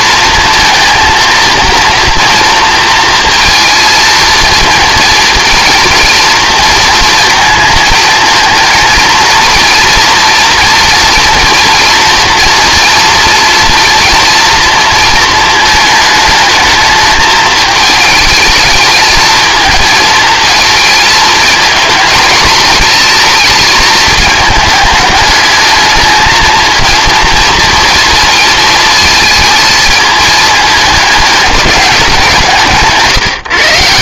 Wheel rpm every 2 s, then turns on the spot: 230, 230, 230, 230, 230, 240, 240, 230, 220, 220, 220, 230, 210, 230, 220, 220, 160.
none